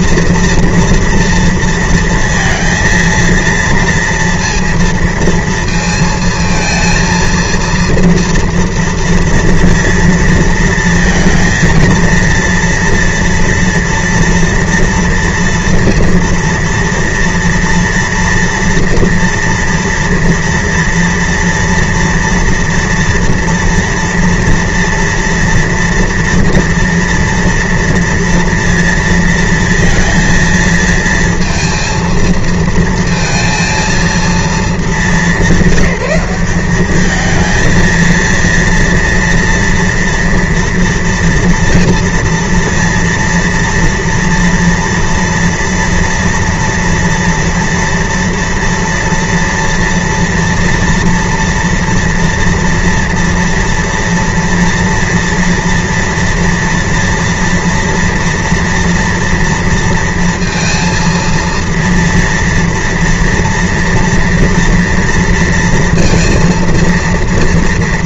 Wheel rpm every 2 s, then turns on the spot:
230, 230, 230, 230, 230, 230, 230, 230, 230, 230, 230, 230, 230, 230, 230, 230, 230, 230, 200, 230, 240, 230, 230, 230, 230, 230, 230, 230, 240, 230, 230, 230, 230, 230.
none